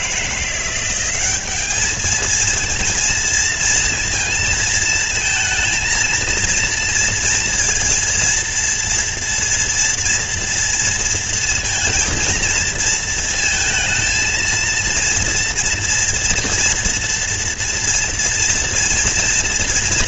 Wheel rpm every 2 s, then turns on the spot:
170, 220, 230, 230, 230, 230, 230, 230, 240, 240.
none